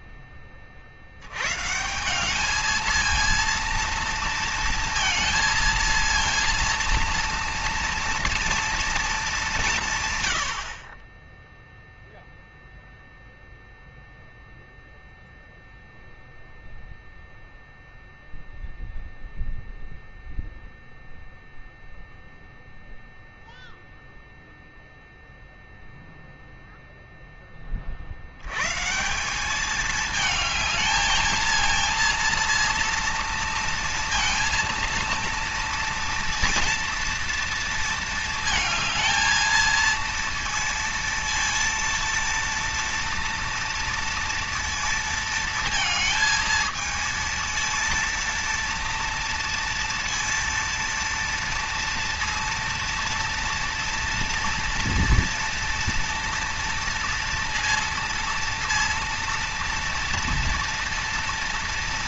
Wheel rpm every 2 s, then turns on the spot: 60, 220, 230, 230, 230, 40, 0, 0, 0, 0, 0, 0, 0, 0, 150, 220, 230, 230, 230, 220, 230, 230, 230, 230, 230, 230, 230, 230, 230, 230, 230.
none